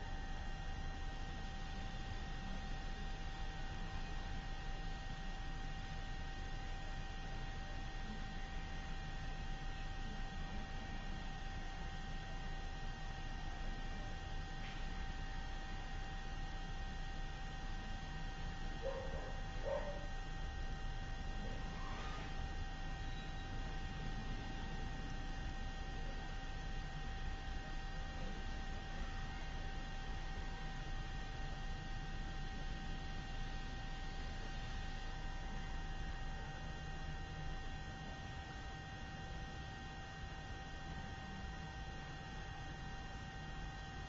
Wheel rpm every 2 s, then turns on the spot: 0, 0, 0, 0, 0, 0, 0, 0, 0, 0, 0, 0, 0, 0, 0, 0, 0, 0, 0, 0, 0, 0.
none